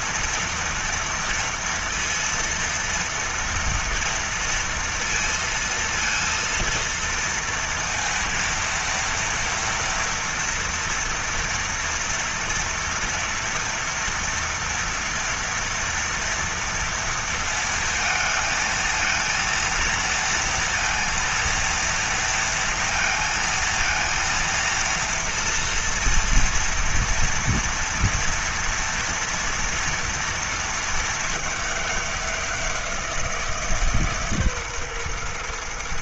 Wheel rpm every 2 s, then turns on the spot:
230, 230, 230, 230, 230, 230, 230, 230, 230, 220, 230, 230, 230, 230, 230, 230, 190, 150.
none